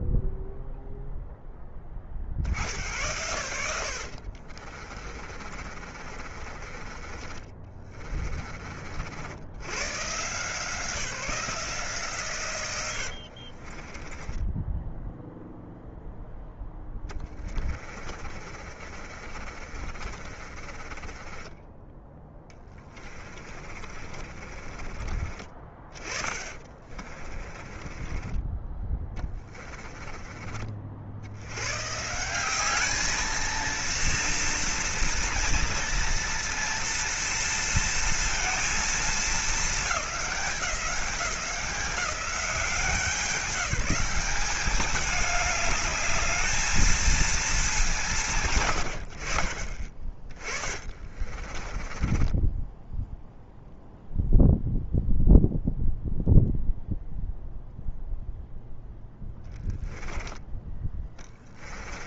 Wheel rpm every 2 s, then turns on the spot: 0, 80, 40, 30, 50, 170, 90, 0, 10, 40, 30, 20, 30, 20, 20, 60, 210, 230, 230, 230, 190, 180, 200, 220, 80, 30, 10, 0, 0, 0, 10.
4-8 12-14 16-30 50-54 60-62